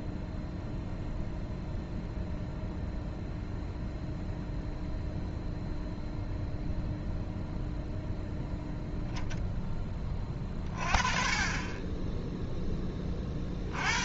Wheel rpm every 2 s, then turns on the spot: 0, 0, 0, 0, 0, 20, 10.
none